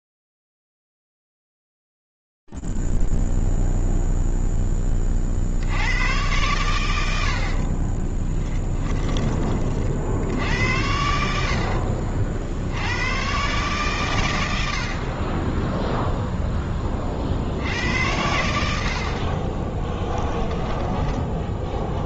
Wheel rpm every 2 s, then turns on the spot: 0, 0, 0, 100, 20, 70, 60, 120, 0, 90, 10.
8-10 20-22